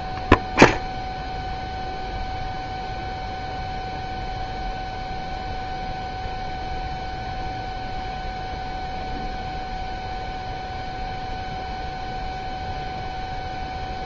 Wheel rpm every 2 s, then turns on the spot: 0, 0, 0, 0, 0, 0, 0.
none